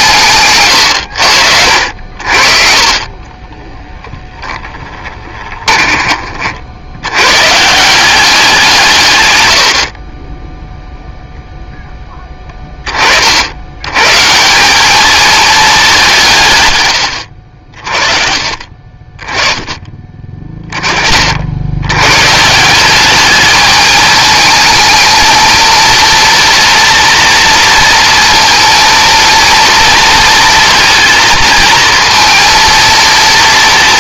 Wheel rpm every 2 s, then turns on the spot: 130, 40, 10, 50, 170, 10, 20, 170, 140, 40, 40, 160, 220, 230, 230, 230, 230.
4-6 10-12